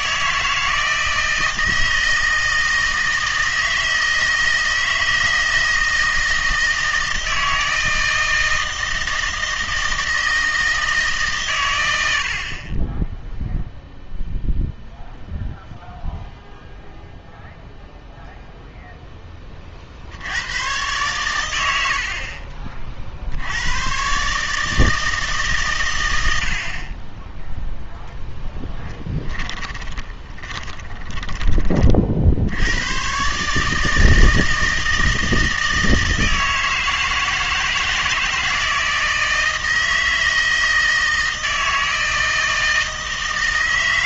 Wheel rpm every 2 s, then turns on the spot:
160, 160, 160, 160, 160, 160, 30, 0, 0, 0, 110, 40, 150, 60, 10, 10, 90, 160, 160, 160, 160, 160.
28-32